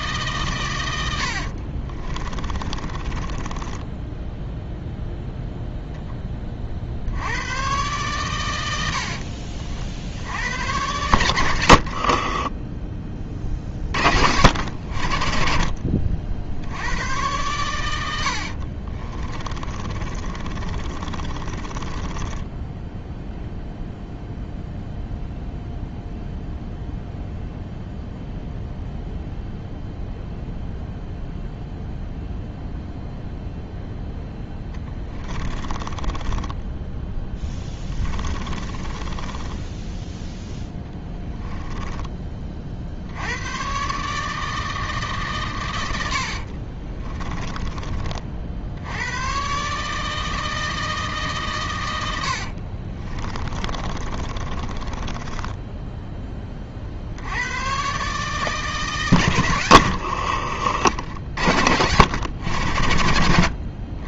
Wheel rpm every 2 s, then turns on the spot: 120, 20, 0, 40, 80, 100, 20, 80, 80, 40, 30, 10, 0, 0, 0, 0, 0, 10, 10, 10, 10, 50, 160, 40, 70, 160, 40, 30, 40, 150, 60, 90.
2-4 12-14 18-24 34-42 46-48 52-56